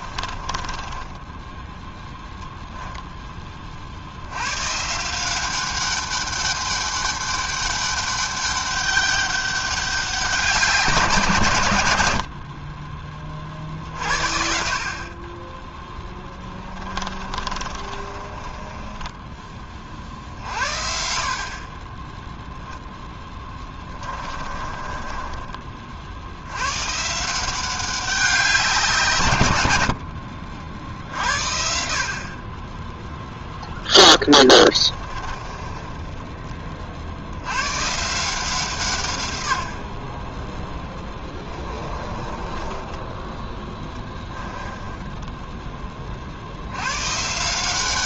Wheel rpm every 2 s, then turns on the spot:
20, 0, 140, 200, 200, 170, 30, 50, 20, 20, 50, 0, 20, 130, 170, 70, 10, 30, 30, 150, 10, 20, 10, 110.
0-2 16-20 24-26 34-36 40-46